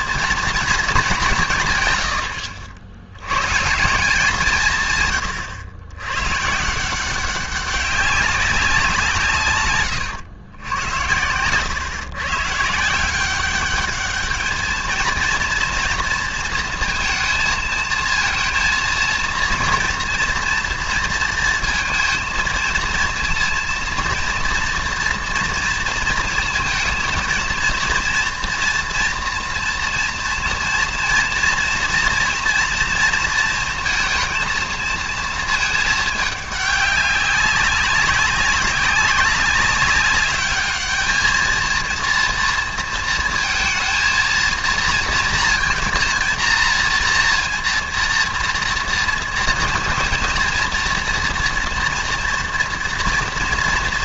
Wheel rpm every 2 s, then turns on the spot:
230, 80, 170, 150, 190, 90, 140, 220, 230, 230, 230, 230, 230, 230, 230, 230, 230, 220, 200, 190, 210, 230, 230, 230, 230, 230, 230.
none